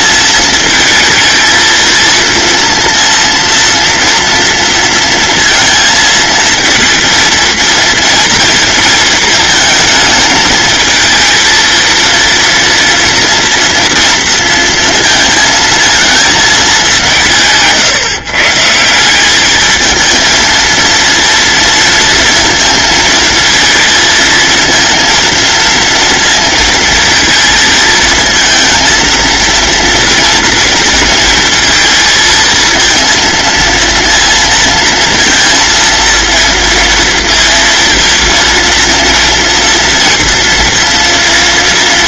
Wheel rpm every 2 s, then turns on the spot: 220, 230, 230, 230, 230, 220, 230, 230, 200, 170, 230, 230, 230, 230, 230, 230, 220, 230, 230, 230, 230.
none